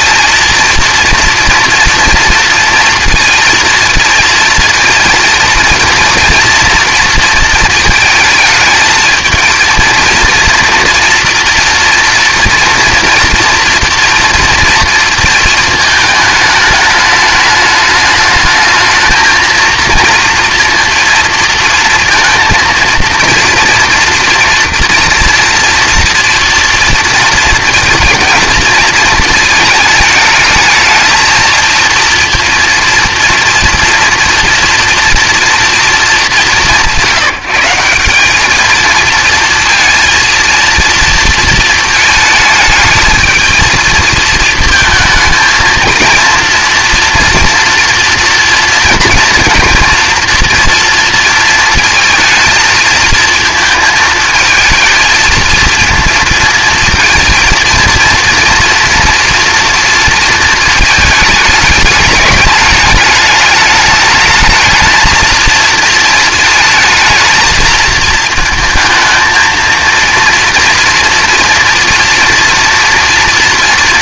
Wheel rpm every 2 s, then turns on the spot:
230, 230, 230, 230, 220, 230, 230, 230, 210, 220, 230, 230, 240, 230, 220, 220, 230, 230, 190, 210, 230, 220, 220, 230, 230, 230, 220, 220, 220, 230, 220, 210, 220, 220, 220, 230, 230.
none